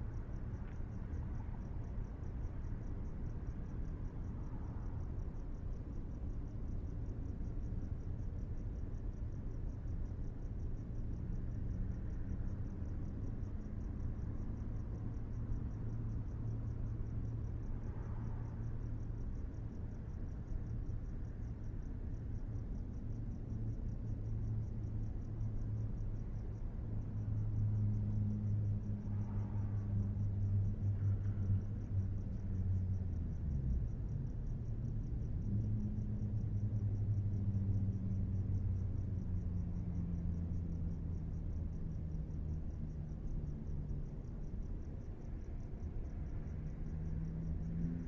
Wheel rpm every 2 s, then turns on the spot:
0, 0, 0, 0, 0, 0, 0, 0, 0, 0, 0, 0, 0, 0, 0, 0, 0, 0, 0, 0, 0, 0, 0, 0.
none